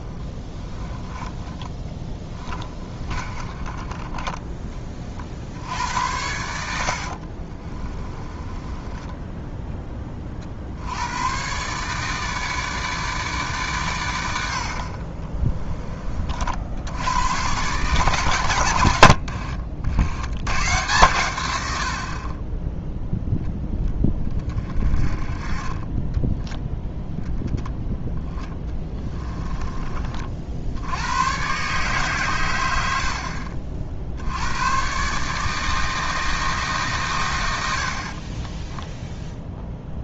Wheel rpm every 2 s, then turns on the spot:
20, 30, 20, 70, 20, 70, 150, 60, 70, 100, 120, 10, 30, 10, 20, 70, 90, 120, 150, 10.
0-4 6-10 28-30 38-40